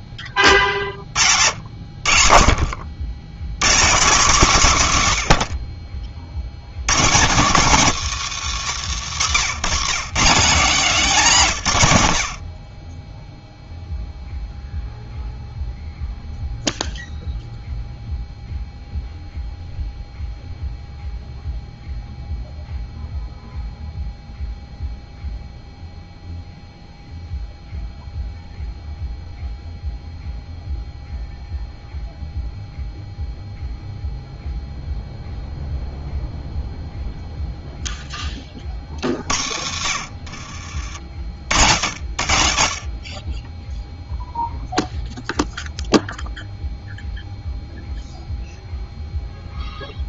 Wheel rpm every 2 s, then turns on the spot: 50, 60, 140, 100, 110, 200, 40, 0, 0, 0, 0, 0, 0, 0, 0, 0, 0, 0, 0, 30, 60, 60, 0, 0, 0.
none